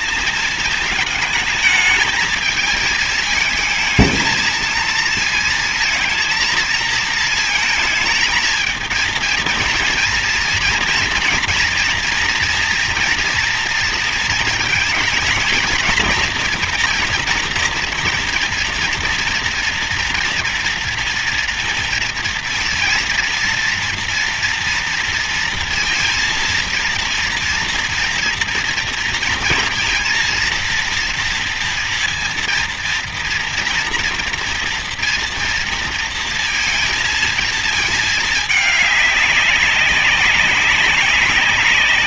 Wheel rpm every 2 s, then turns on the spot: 210, 220, 220, 230, 220, 230, 230, 230, 230, 230, 230, 230, 230, 230, 230, 230, 230, 230, 230, 210, 200.
none